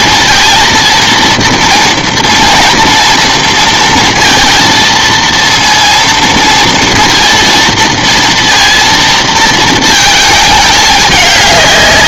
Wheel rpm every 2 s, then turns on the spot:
230, 240, 230, 230, 230, 210.
none